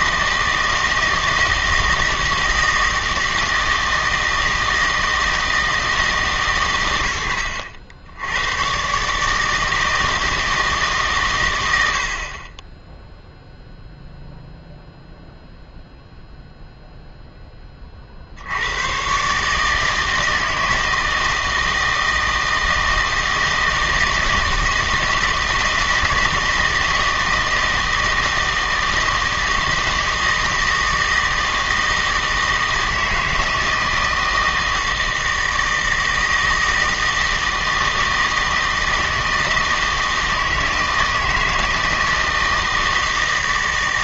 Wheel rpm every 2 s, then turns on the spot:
160, 160, 160, 120, 120, 160, 20, 0, 0, 80, 160, 160, 160, 160, 160, 160, 160, 160, 160, 160, 160, 160.
none